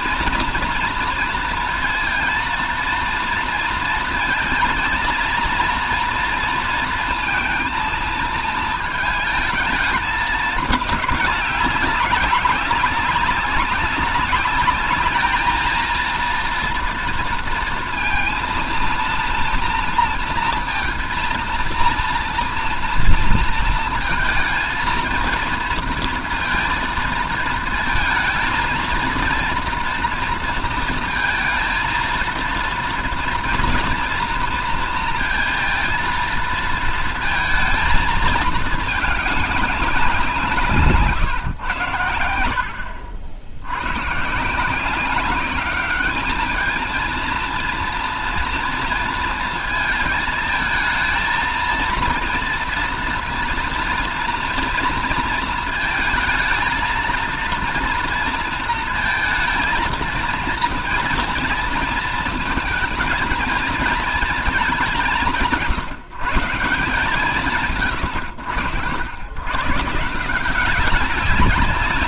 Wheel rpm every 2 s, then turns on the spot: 230, 230, 230, 230, 230, 210, 190, 200, 230, 230, 230, 230, 230, 230, 230, 230, 230, 230, 230, 220, 150, 70, 160, 220, 230, 220, 230, 230, 220, 230, 230, 220, 210, 170, 100, 180.
none